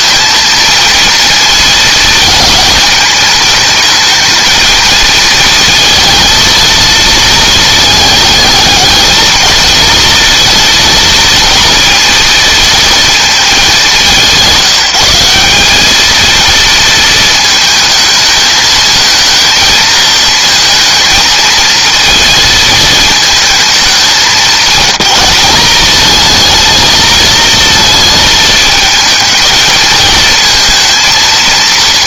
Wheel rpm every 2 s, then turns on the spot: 230, 220, 220, 220, 220, 230, 230, 180, 230, 220, 220, 220, 210, 230, 220, 230.
none